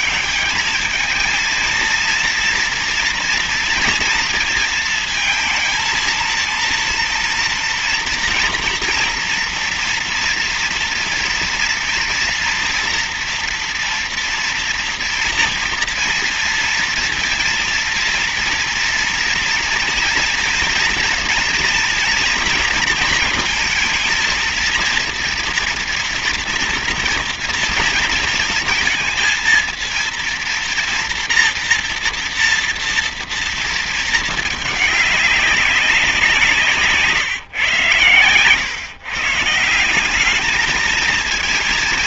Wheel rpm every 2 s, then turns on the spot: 220, 230, 230, 230, 230, 230, 230, 230, 230, 230, 230, 230, 230, 230, 220, 230, 230, 210, 170, 130, 210.
36-38